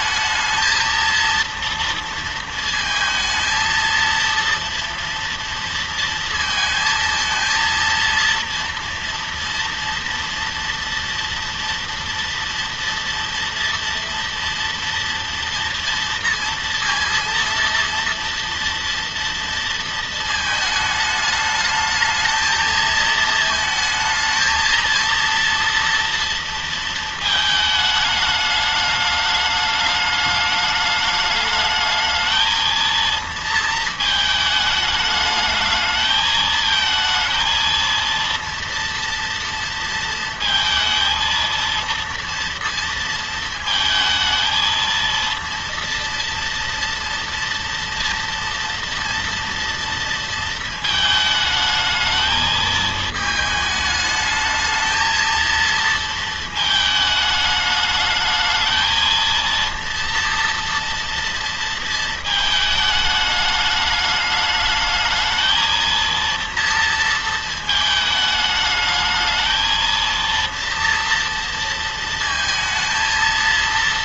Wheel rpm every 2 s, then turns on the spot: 230, 230, 230, 220, 230, 230, 230, 230, 230, 230, 220, 220, 230, 230, 210, 210, 220, 220, 220, 230, 230, 230, 230, 230, 230, 220, 220, 220, 220, 220, 230, 220, 210, 230, 210, 230, 220.
none